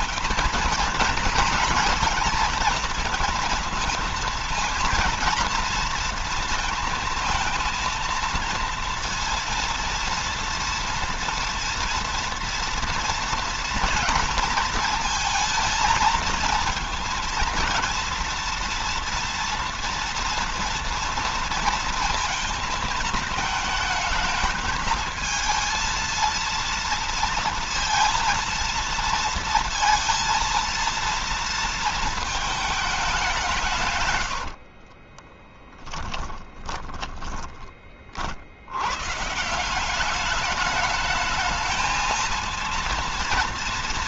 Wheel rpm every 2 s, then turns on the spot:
230, 230, 230, 230, 230, 230, 230, 230, 220, 230, 230, 220, 220, 230, 230, 230, 210, 50, 20, 100, 210, 230.
34-38